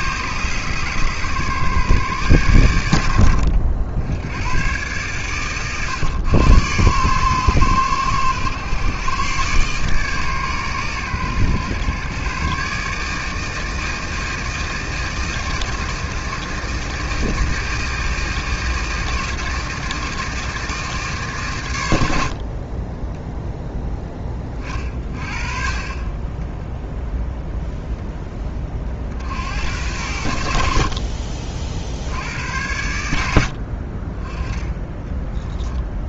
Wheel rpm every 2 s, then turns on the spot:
130, 100, 120, 110, 110, 120, 140, 160, 160, 160, 150, 20, 30, 0, 40, 50, 90, 20.
34-36